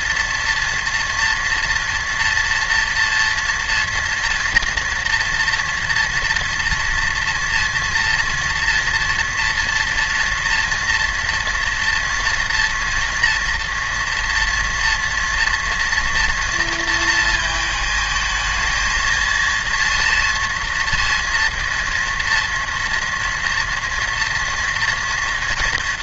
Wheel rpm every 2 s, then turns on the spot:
230, 230, 230, 230, 230, 230, 230, 230, 230, 220, 230, 230, 230.
none